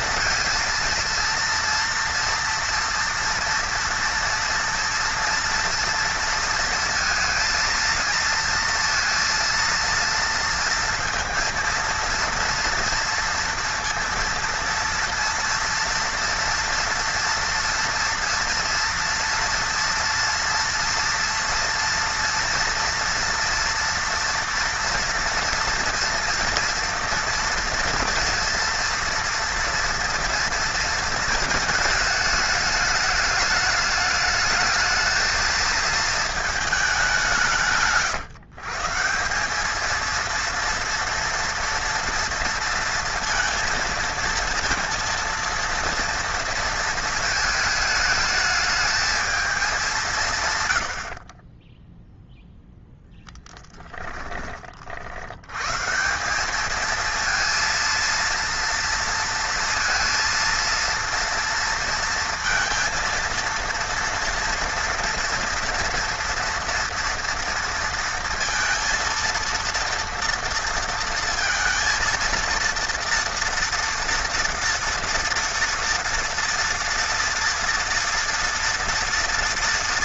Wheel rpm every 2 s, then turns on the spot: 230, 230, 230, 230, 230, 230, 230, 230, 230, 230, 230, 230, 230, 230, 230, 230, 210, 220, 220, 140, 230, 230, 230, 230, 220, 130, 0, 40, 200, 230, 230, 230, 230, 230, 230, 230, 230, 230, 230, 230.
none